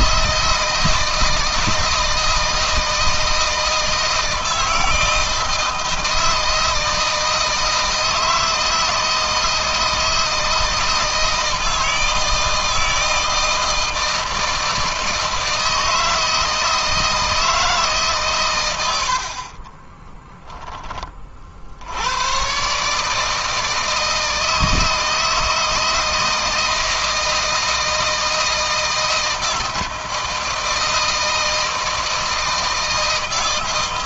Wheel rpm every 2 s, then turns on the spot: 160, 160, 160, 160, 160, 160, 160, 160, 160, 90, 20, 150, 160, 160, 160, 160, 160.
none